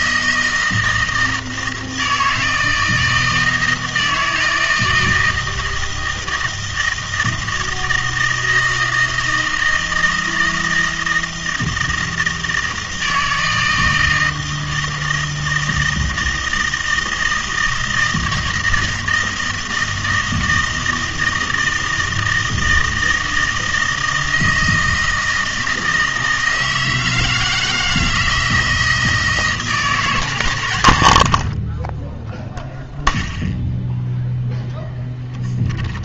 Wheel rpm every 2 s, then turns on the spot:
160, 160, 160, 160, 160, 160, 160, 160, 160, 160, 160, 160, 160, 160, 160, 100, 0, 0.
none